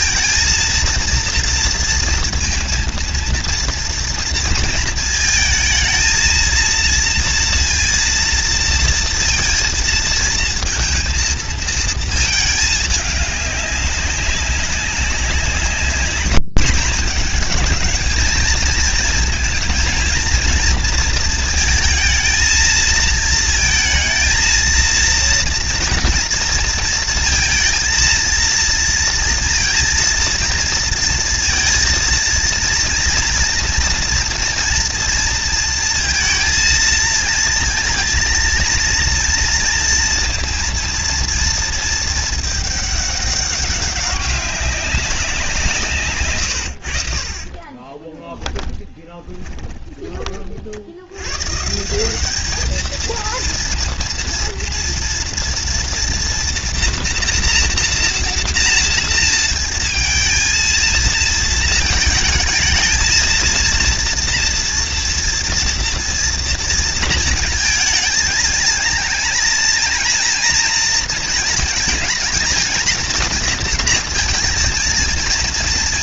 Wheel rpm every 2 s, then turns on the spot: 230, 230, 230, 230, 230, 230, 210, 190, 210, 230, 230, 230, 230, 230, 230, 230, 230, 230, 230, 230, 230, 210, 190, 90, 20, 50, 220, 230, 230, 230, 220, 220, 230, 230, 220, 230, 220, 230.
48-50